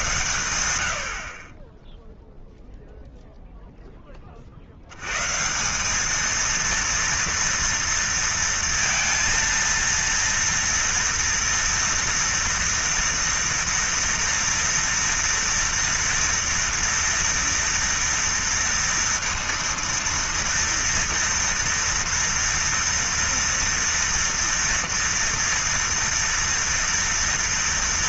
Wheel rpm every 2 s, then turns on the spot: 50, 10, 190, 230, 230, 230, 230, 230, 230, 230, 230, 240, 240, 200.
none